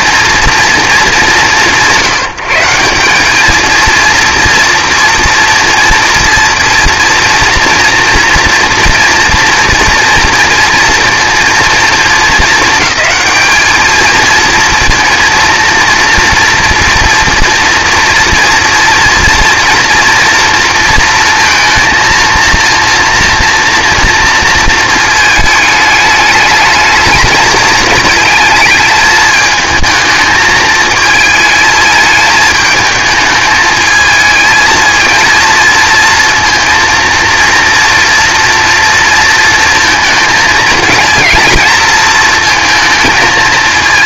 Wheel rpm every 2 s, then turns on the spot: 220, 150, 230, 230, 230, 230, 220, 230, 230, 240, 230, 230, 230, 220, 220, 220, 220, 220, 230, 230, 220, 230.
none